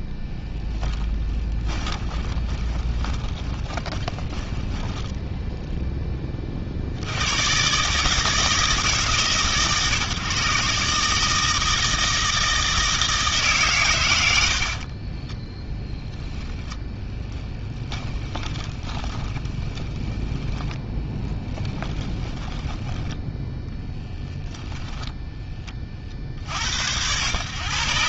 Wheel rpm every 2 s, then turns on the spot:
10, 20, 10, 60, 150, 130, 160, 30, 10, 20, 20, 10, 10, 80.
0-6 16-26